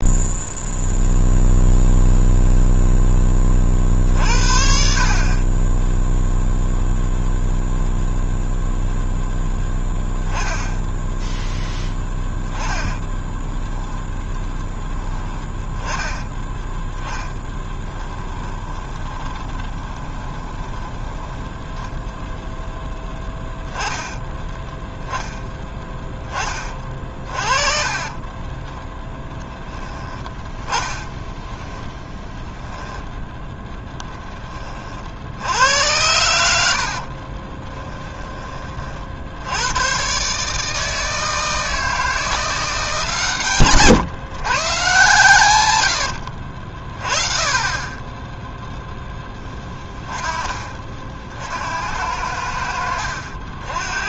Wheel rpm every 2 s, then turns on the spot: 0, 0, 50, 0, 0, 10, 10, 10, 10, 20, 10, 0, 10, 30, 10, 10, 10, 30, 80, 30, 150, 160, 140, 50, 0, 30, 70.
18-20 28-30